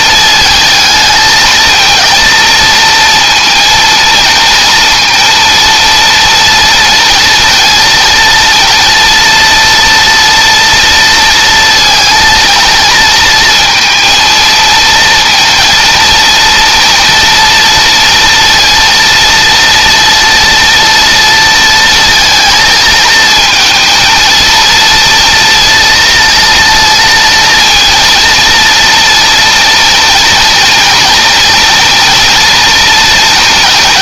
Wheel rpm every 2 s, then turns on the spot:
220, 230, 230, 230, 230, 230, 230, 230, 230, 230, 230, 220, 230, 230, 230, 230, 230.
none